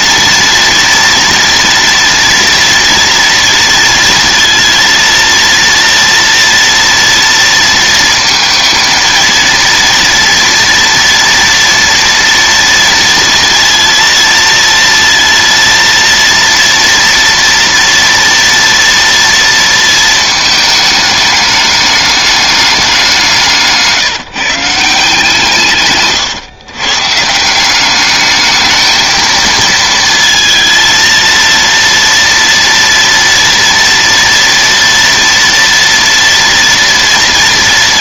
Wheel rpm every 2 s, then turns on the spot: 230, 230, 230, 230, 230, 240, 230, 230, 230, 230, 210, 170, 170, 150, 220, 230, 230, 230, 230.
none